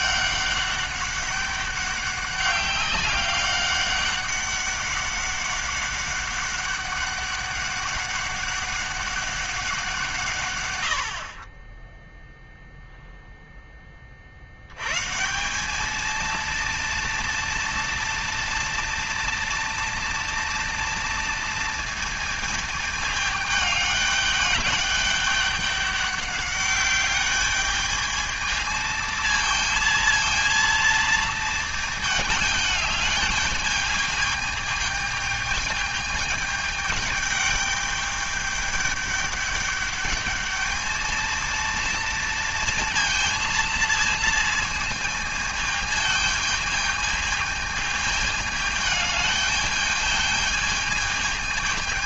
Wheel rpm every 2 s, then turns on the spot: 200, 200, 200, 200, 190, 90, 0, 120, 230, 230, 230, 220, 210, 200, 220, 230, 210, 210, 210, 210, 220, 230, 220, 220, 210, 220.
none